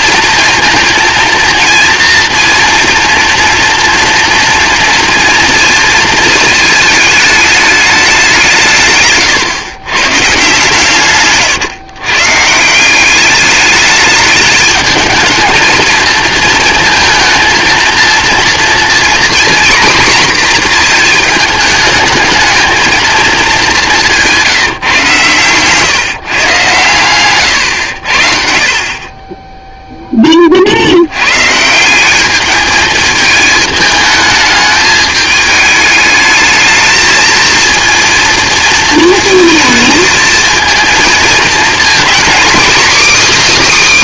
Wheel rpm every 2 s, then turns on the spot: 230, 230, 230, 220, 130, 140, 200, 220, 220, 240, 230, 220, 130, 130, 30, 90, 220, 210, 220, 230, 220, 280.
28-30